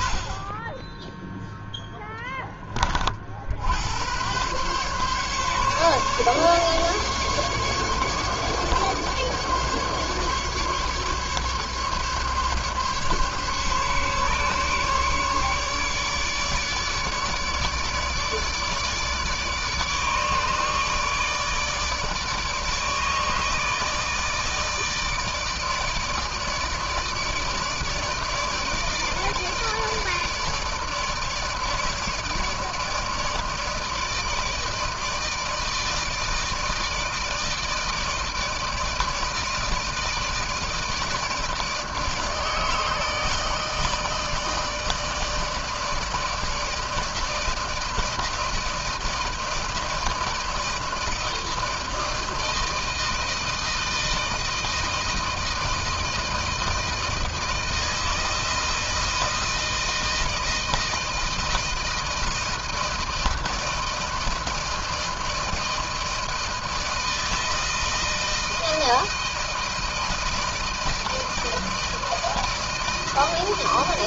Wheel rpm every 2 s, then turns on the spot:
30, 10, 120, 140, 140, 140, 140, 140, 150, 150, 150, 150, 150, 150, 160, 150, 150, 160, 160, 160, 160, 160, 160, 160, 160, 160, 160, 160, 160, 160, 160, 160, 160, 160, 160, 160, 160.
none